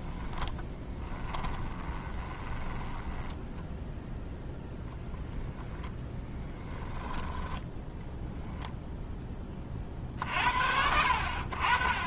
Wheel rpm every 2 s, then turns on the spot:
10, 10, 0, 10, 0, 60.
0-2 6-8